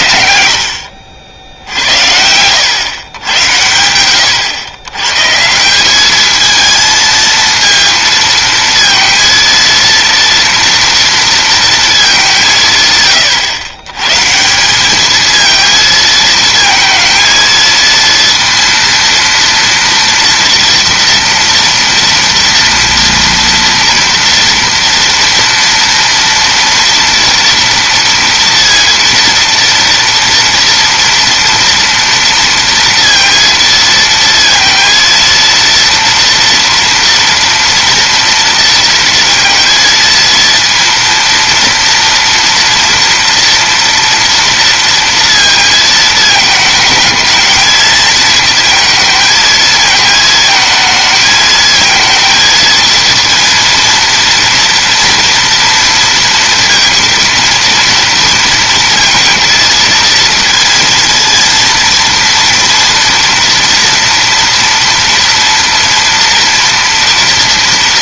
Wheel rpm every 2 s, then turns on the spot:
70, 120, 110, 220, 230, 230, 140, 190, 230, 230, 230, 230, 230, 230, 230, 230, 230, 230, 230, 230, 230, 230, 230, 220, 230, 220, 230, 230, 230, 230, 230, 230, 230, 230.
none